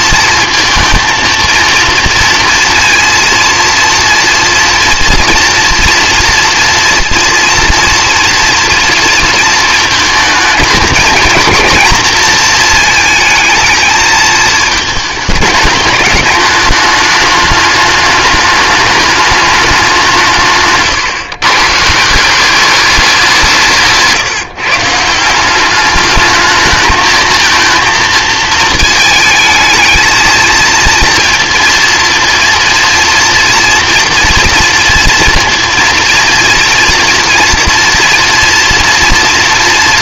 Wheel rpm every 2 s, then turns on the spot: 230, 230, 230, 240, 230, 220, 230, 220, 210, 210, 140, 200, 160, 220, 220, 230, 230, 230, 230, 230.
20-22